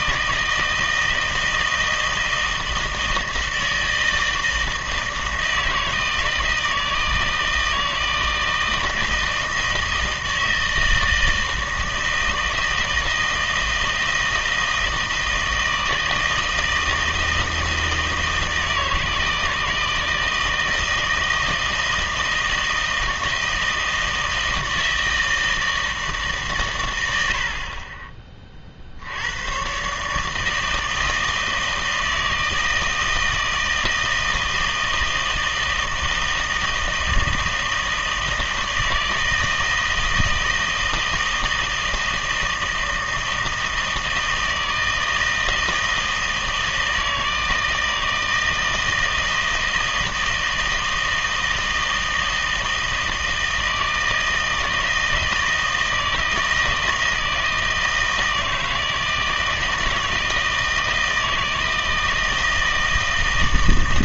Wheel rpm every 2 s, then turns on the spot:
160, 160, 160, 160, 160, 160, 160, 160, 160, 160, 160, 160, 160, 90, 70, 160, 160, 160, 160, 160, 160, 160, 160, 160, 160, 160, 160, 160, 160, 160, 160, 160.
none